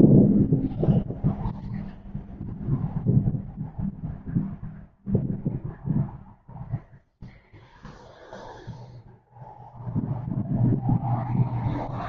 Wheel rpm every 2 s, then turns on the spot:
0, 0, 0, 0, 0, 0.
none